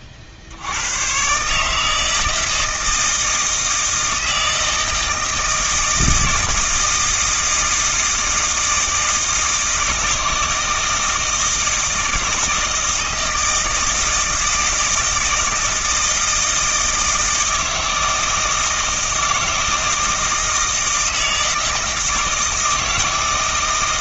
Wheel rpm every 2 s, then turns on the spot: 100, 160, 160, 160, 160, 160, 160, 160, 160, 160, 160, 160.
none